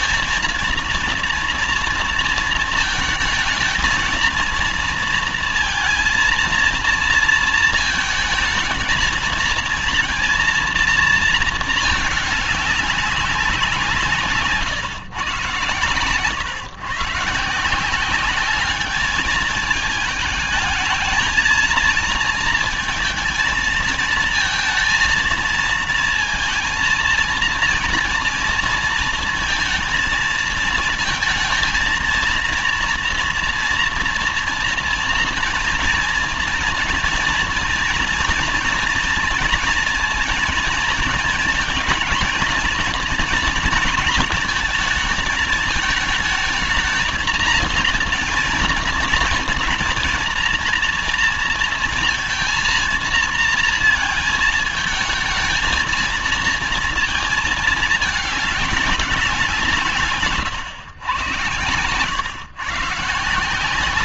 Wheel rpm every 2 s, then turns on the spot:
230, 230, 230, 230, 230, 230, 210, 150, 110, 200, 220, 230, 230, 230, 230, 220, 230, 230, 240, 230, 230, 230, 230, 220, 230, 230, 230, 220, 230, 210, 130, 140.
none